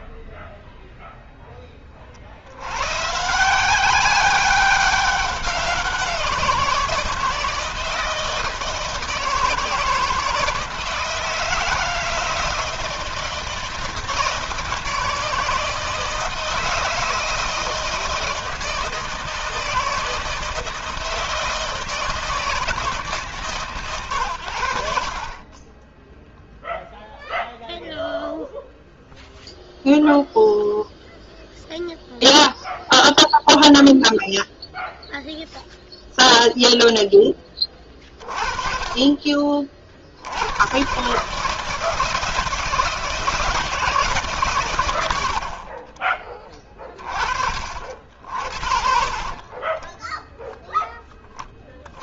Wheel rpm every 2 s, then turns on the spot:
0, 70, 200, 170, 160, 160, 160, 160, 160, 160, 160, 160, 90, 0, 0, 0, 0, 0, 0, 30, 90, 160, 150, 30, 50, 0.
46-48